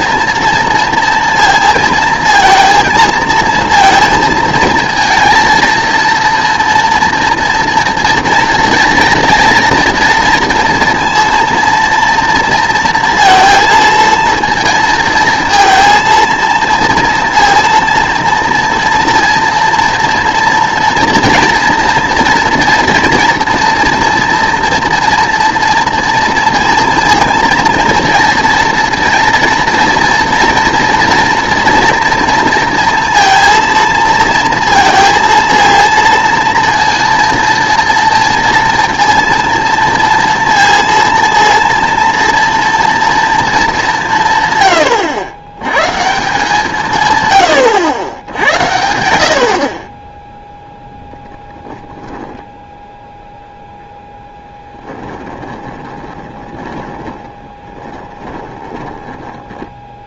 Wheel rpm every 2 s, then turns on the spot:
230, 230, 230, 240, 230, 230, 230, 230, 230, 230, 230, 230, 230, 230, 230, 230, 230, 230, 230, 240, 230, 230, 110, 160, 80, 10, 0, 10, 20, 20.
54-60